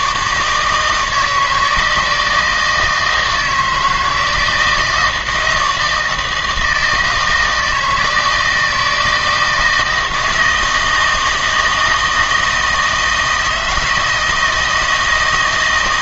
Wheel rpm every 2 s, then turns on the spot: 150, 160, 160, 160, 160, 160, 160, 160.
none